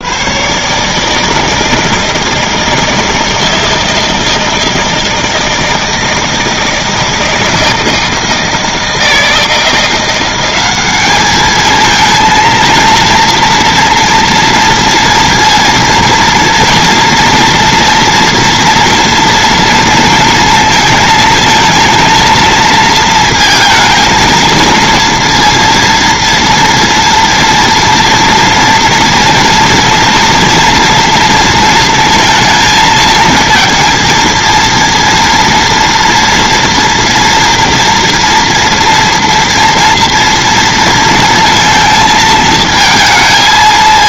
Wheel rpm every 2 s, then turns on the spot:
140, 160, 160, 160, 160, 190, 230, 230, 230, 230, 230, 230, 230, 230, 230, 230, 220, 230, 240, 240, 230, 220.
none